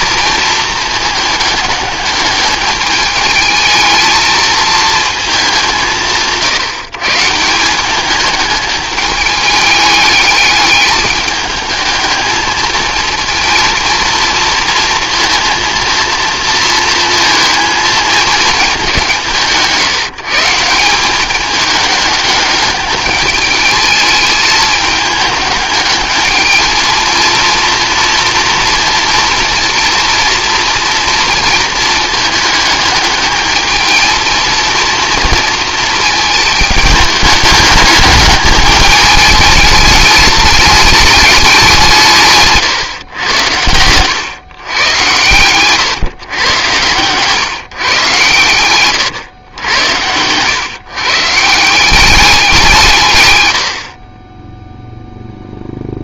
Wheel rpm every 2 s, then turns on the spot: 220, 210, 220, 160, 210, 210, 220, 230, 230, 200, 170, 200, 210, 220, 240, 230, 210, 220, 210, 210, 200, 140, 120, 120, 120, 120, 180, 0.
48-50